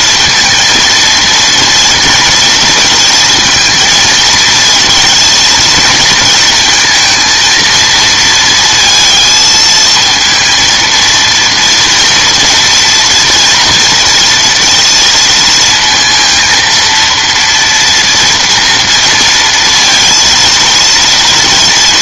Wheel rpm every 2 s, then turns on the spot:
230, 230, 230, 220, 230, 230, 230, 230, 230, 230, 230.
none